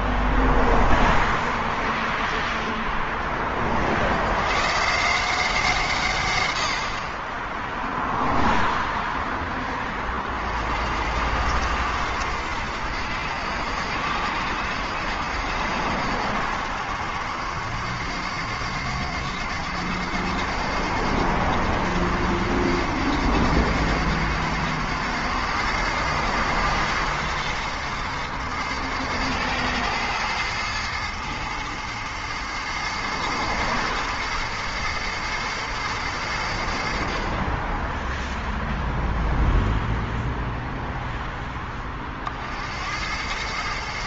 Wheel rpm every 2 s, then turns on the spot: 0, 0, 90, 110, 0, 60, 90, 80, 90, 90, 90, 90, 100, 110, 110, 110, 110, 110, 20, 0, 10, 100.
none